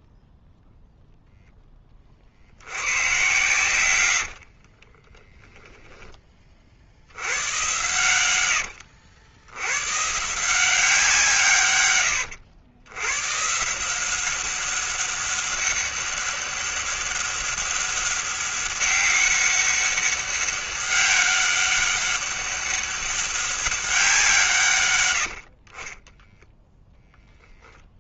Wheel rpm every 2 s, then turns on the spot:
0, 100, 40, 60, 90, 180, 120, 190, 200, 190, 200, 200, 140, 0.
4-6 8-10